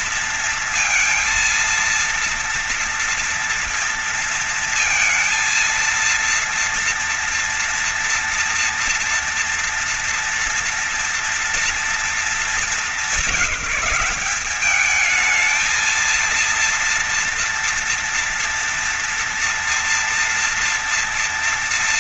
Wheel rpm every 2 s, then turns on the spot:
230, 230, 230, 230, 230, 230, 220, 210, 230, 230, 230.
none